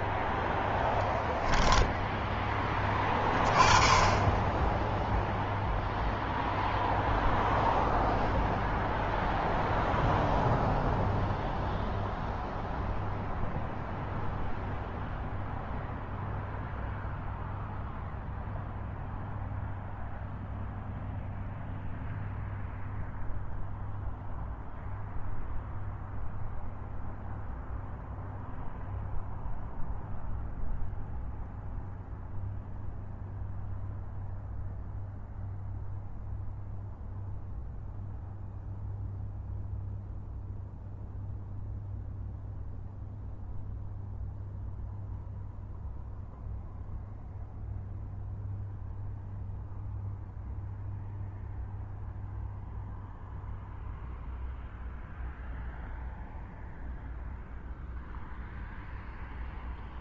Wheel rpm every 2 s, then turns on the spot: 10, 10, 0, 0, 0, 0, 0, 0, 0, 0, 0, 0, 0, 0, 0, 0, 0, 0, 0, 0, 0, 0, 0, 0, 0, 0, 0, 0, 0, 0.
none